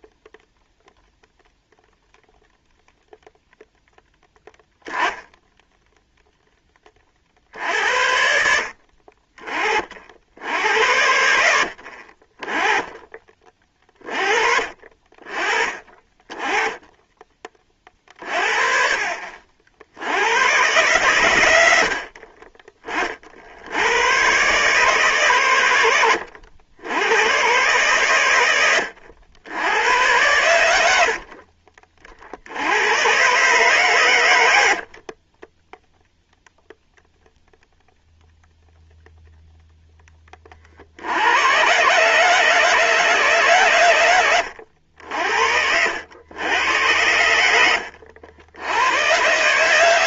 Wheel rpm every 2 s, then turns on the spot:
0, 0, 0, 50, 40, 80, 20, 30, 20, 50, 120, 50, 130, 100, 80, 60, 120, 40, 0, 0, 70, 140, 80, 90, 110.
30-32